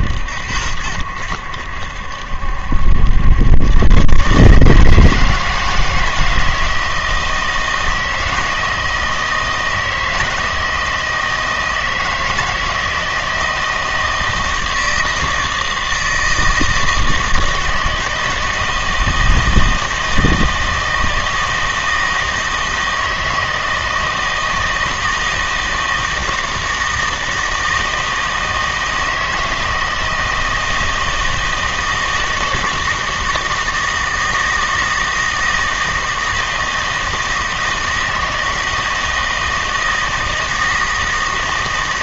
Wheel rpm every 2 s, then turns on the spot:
80, 70, 150, 160, 160, 160, 160, 160, 160, 160, 160, 160, 160, 160, 160, 160, 160, 160, 160, 160, 160.
none